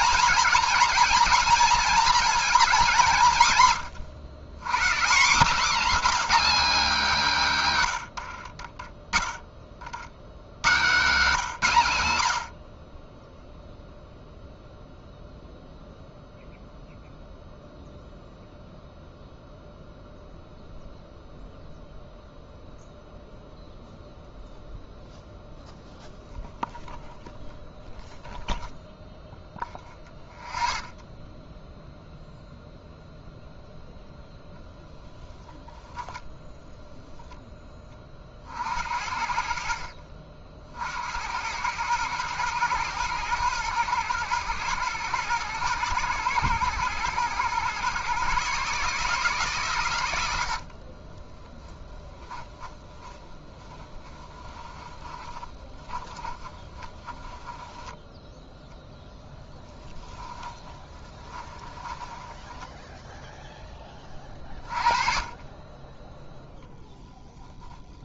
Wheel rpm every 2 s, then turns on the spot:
240, 220, 140, 240, 50, 120, 50, 0, 0, 0, 0, 0, 0, 0, 0, 0, 0, 0, 10, 50, 60, 110, 120, 120, 140, 70, 20, 20, 30, 0, 20, 10, 30, 0.
50-58 60-64